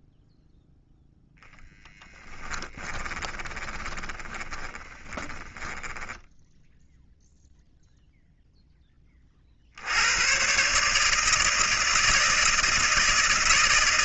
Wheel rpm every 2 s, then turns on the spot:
0, 20, 10, 0, 10, 140, 160.
2-6